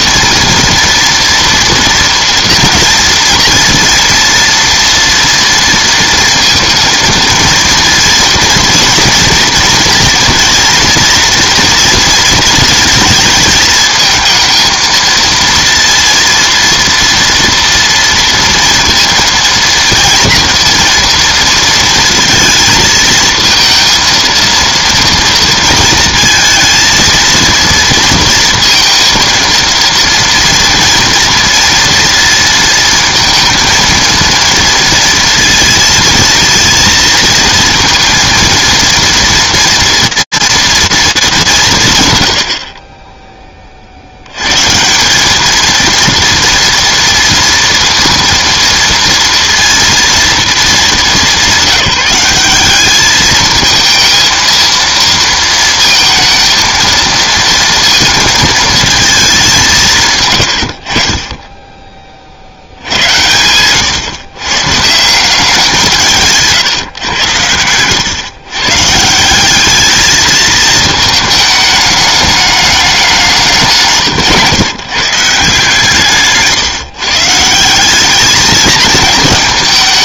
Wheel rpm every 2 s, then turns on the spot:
230, 230, 230, 230, 230, 230, 230, 220, 230, 230, 230, 230, 230, 230, 230, 230, 230, 230, 230, 230, 230, 50, 130, 230, 230, 220, 200, 230, 230, 230, 100, 70, 140, 140, 140, 220, 200, 140, 140, 220.
none